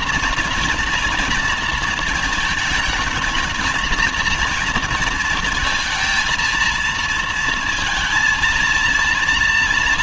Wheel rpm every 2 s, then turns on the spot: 240, 220, 220, 220, 230.
none